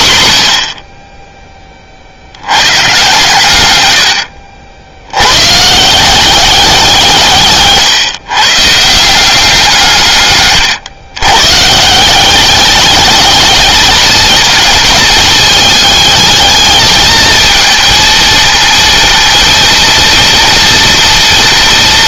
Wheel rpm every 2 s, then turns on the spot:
70, 110, 70, 180, 150, 130, 200, 220, 220, 230, 230.
none